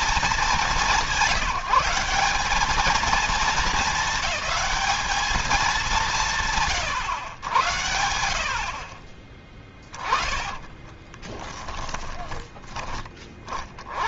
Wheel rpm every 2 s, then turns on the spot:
190, 210, 210, 120, 40, 20, 40.
10-12